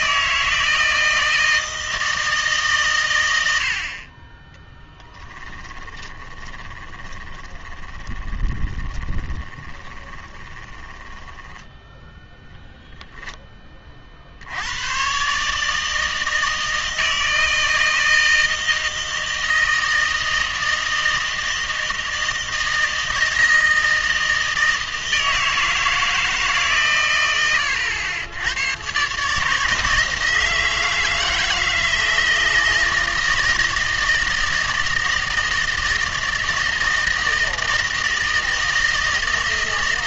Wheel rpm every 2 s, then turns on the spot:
160, 140, 10, 20, 20, 20, 0, 90, 160, 160, 160, 160, 160, 140, 110, 160, 160, 160, 160, 160.
6-12